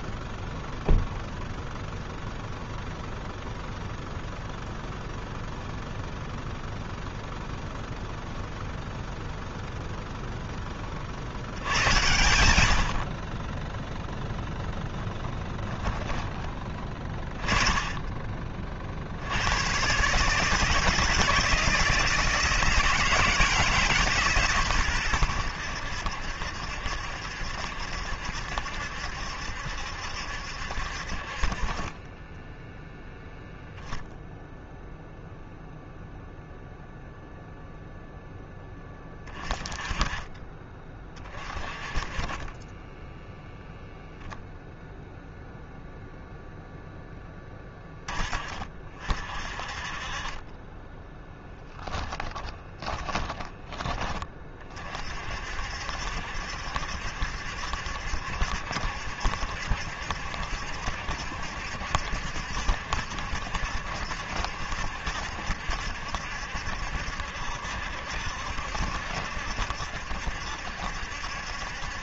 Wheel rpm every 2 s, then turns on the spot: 0, 0, 0, 0, 0, 20, 70, 10, 30, 40, 150, 160, 120, 70, 70, 60, 10, 0, 0, 10, 30, 20, 0, 0, 30, 20, 20, 50, 70, 70, 70, 70, 70, 70, 70, 70.
14-16 52-54